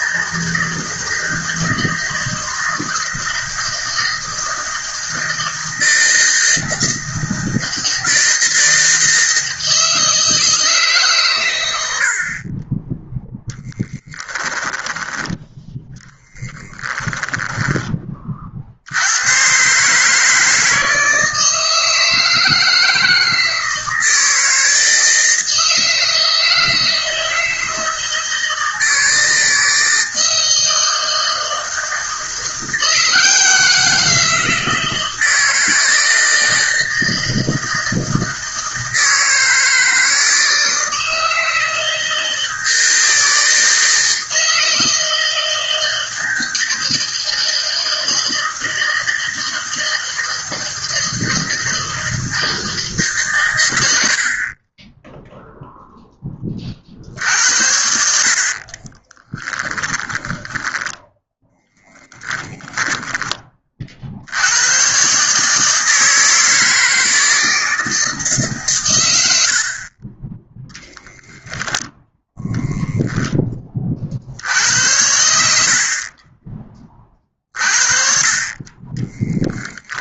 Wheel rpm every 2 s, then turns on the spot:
160, 160, 160, 160, 160, 140, 10, 20, 10, 80, 160, 160, 160, 160, 160, 160, 170, 160, 160, 160, 160, 160, 160, 160, 160, 160, 150, 10, 50, 30, 10, 10, 120, 160, 110, 0, 0, 80, 20, 30.
58-64 78-80